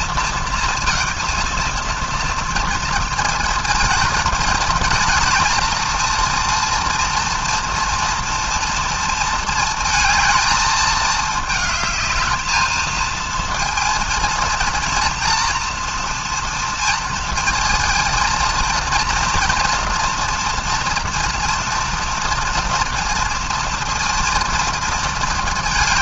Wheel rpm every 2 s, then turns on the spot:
230, 230, 220, 230, 230, 220, 220, 230, 230, 230, 230, 240, 230.
none